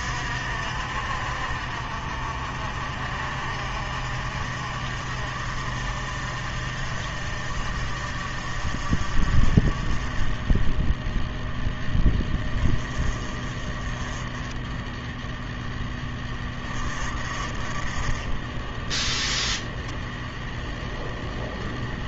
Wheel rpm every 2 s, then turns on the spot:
60, 50, 50, 50, 50, 20, 20, 10, 20, 10, 10.
none